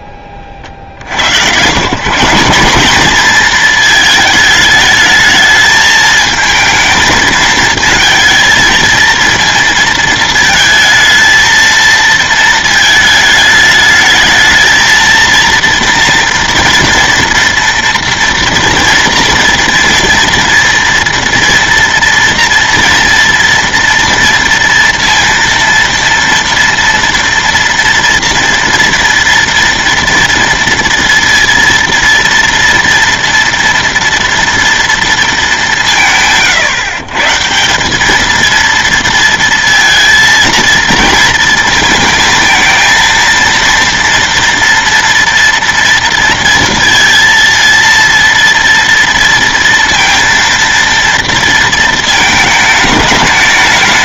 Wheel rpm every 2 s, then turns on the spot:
60, 200, 220, 220, 220, 230, 220, 220, 230, 230, 230, 230, 230, 230, 230, 230, 230, 230, 130, 230, 230, 230, 240, 230, 230, 230, 220.
none